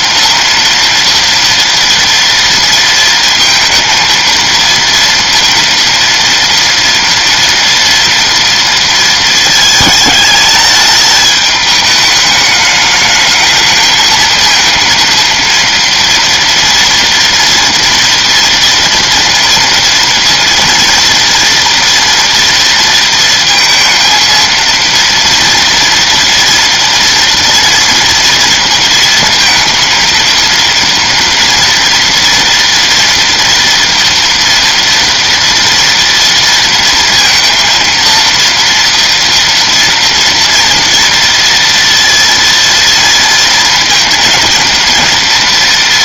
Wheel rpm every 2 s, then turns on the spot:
230, 230, 230, 230, 230, 210, 210, 220, 230, 230, 230, 230, 230, 230, 230, 230, 240, 240, 230, 230, 230, 230, 230.
none